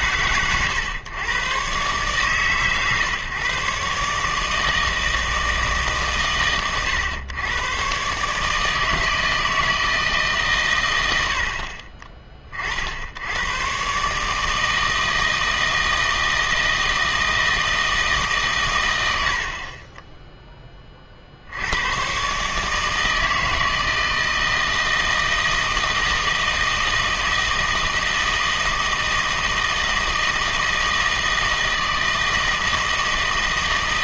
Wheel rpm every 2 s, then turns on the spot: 120, 130, 160, 120, 150, 130, 40, 160, 160, 120, 20, 150, 160, 160, 160, 160, 160.
none